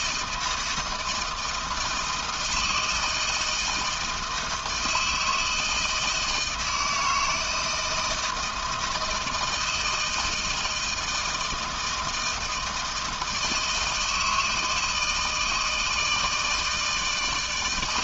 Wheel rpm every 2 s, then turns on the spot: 170, 160, 160, 160, 160, 160, 160, 160, 160.
none